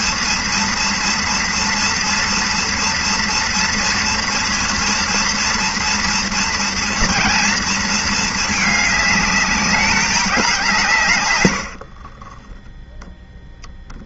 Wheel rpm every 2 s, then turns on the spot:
230, 240, 230, 230, 220, 180, 20.
12-14